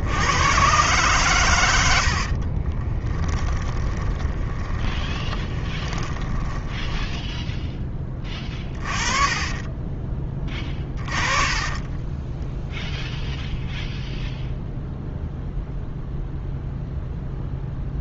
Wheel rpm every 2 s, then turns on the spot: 120, 20, 20, 10, 30, 30, 0, 0, 0.
2-8 10-12